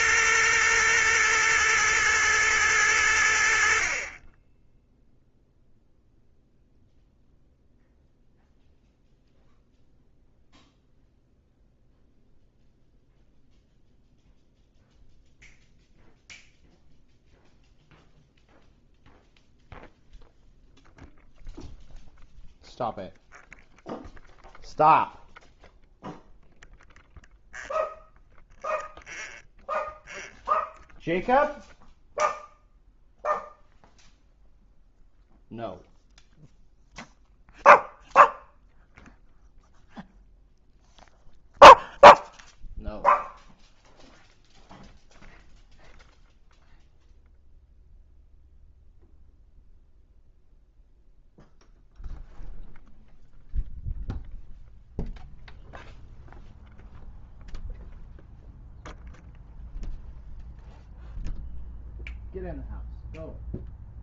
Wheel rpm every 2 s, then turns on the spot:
120, 100, 10, 0, 0, 0, 0, 0, 0, 0, 0, 0, 0, 0, 0, 0, 0, 0, 0, 0, 0, 0, 0, 0, 0, 0, 0, 0, 0, 0, 0, 0.
none